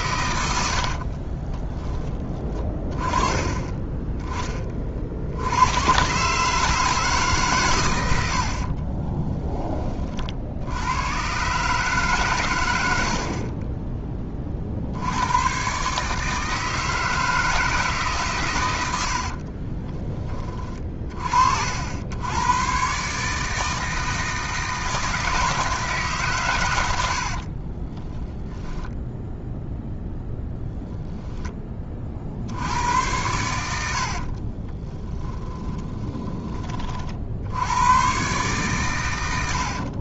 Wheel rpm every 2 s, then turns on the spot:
70, 30, 40, 150, 40, 90, 90, 60, 160, 70, 30, 130, 160, 100, 10, 0, 90, 10, 40, 110.
8-10 26-30 34-36